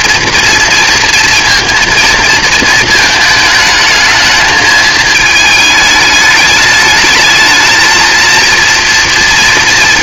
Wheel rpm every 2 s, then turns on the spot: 240, 220, 220, 210, 230.
none